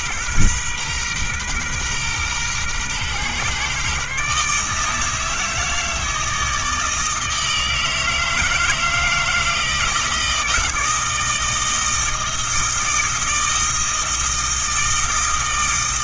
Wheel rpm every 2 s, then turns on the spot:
130, 120, 150, 160, 160, 160, 160, 160.
none